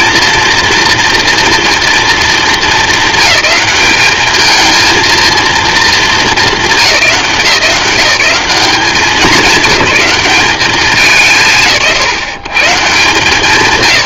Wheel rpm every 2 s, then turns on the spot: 230, 220, 220, 200, 190, 190, 170.
none